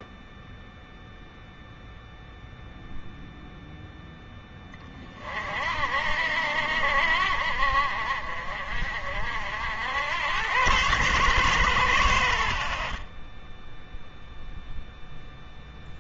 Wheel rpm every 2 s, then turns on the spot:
0, 0, 20, 60, 50, 100, 50, 0.
none